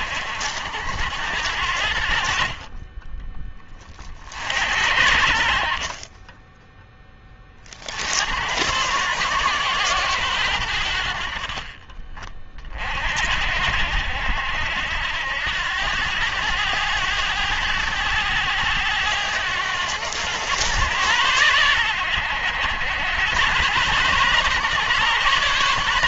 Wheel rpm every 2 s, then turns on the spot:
80, 40, 50, 10, 100, 80, 40, 80, 100, 100, 110, 90, 140.
none